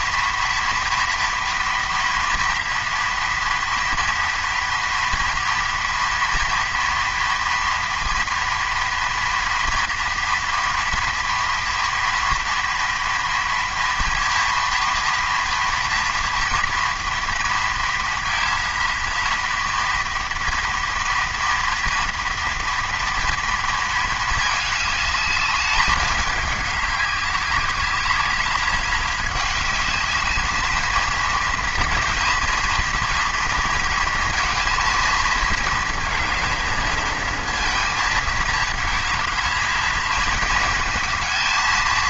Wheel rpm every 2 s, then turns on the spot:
230, 230, 230, 230, 230, 230, 230, 230, 230, 230, 230, 230, 210, 200, 210, 220, 230, 230, 220, 220, 230.
none